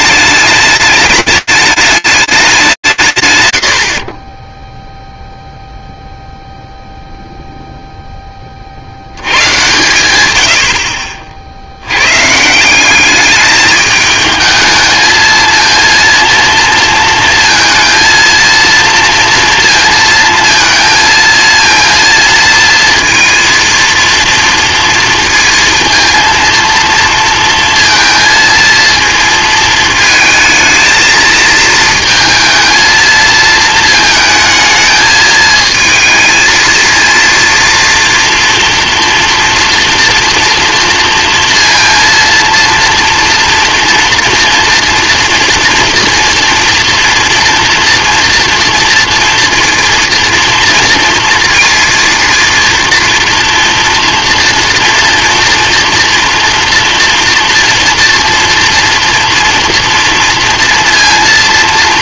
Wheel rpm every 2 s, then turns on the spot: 210, 190, 10, 0, 60, 70, 190, 220, 230, 230, 230, 230, 230, 230, 230, 230, 220, 220, 230, 230, 230, 230, 230, 230, 230, 230, 230, 230, 230, 240, 230.
none